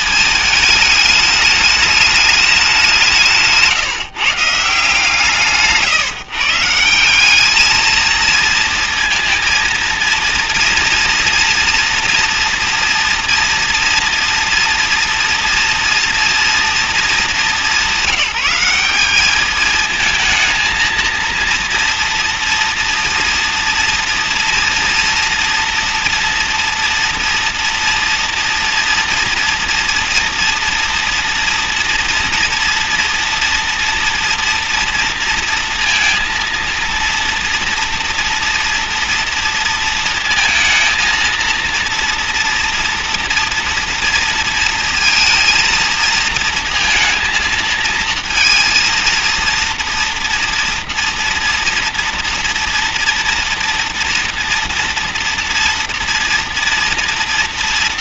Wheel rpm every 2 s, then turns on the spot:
220, 200, 150, 150, 230, 230, 230, 230, 230, 180, 230, 230, 230, 240, 240, 230, 230, 240, 230, 230, 220, 230, 230, 230, 230, 230, 230, 230, 230.
none